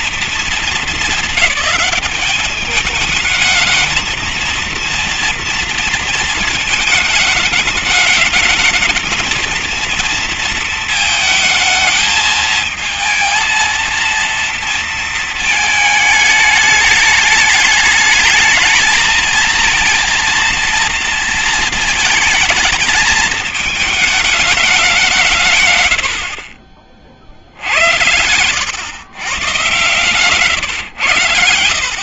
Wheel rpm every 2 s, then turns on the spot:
220, 210, 230, 220, 220, 220, 220, 230, 210, 220, 230, 220, 210, 50, 100, 120.
none